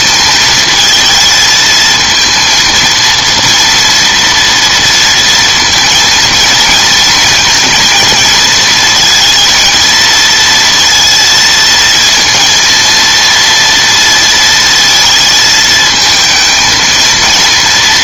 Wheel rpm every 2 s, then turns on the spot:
220, 230, 230, 230, 220, 230, 230, 230, 220.
none